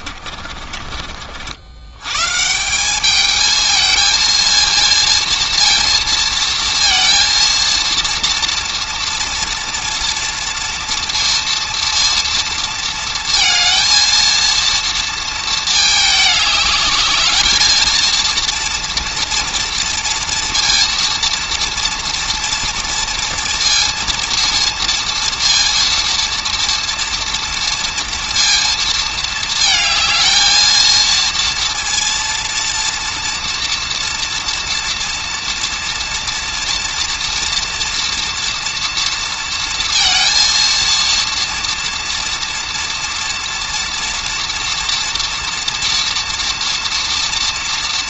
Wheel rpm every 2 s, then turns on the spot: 60, 210, 230, 230, 240, 230, 230, 230, 220, 230, 230, 230, 230, 230, 220, 230, 230, 230, 230, 230, 230, 230, 230, 230.
none